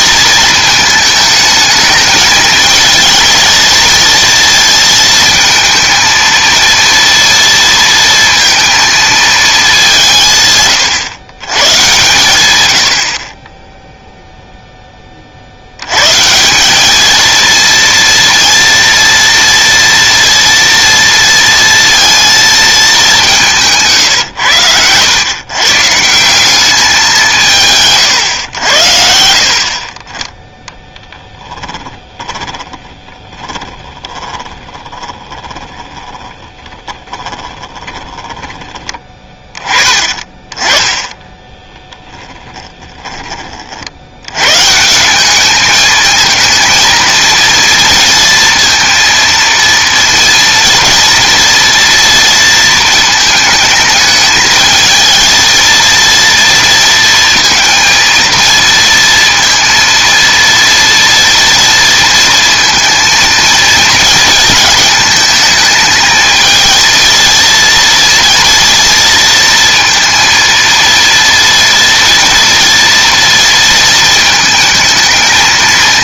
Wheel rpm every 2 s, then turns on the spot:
220, 220, 230, 230, 230, 130, 90, 0, 190, 230, 230, 220, 110, 200, 90, 10, 30, 20, 20, 20, 20, 10, 130, 230, 230, 230, 230, 220, 230, 230, 230, 230, 220, 230, 230, 230, 230, 220.
24-26 32-38 42-44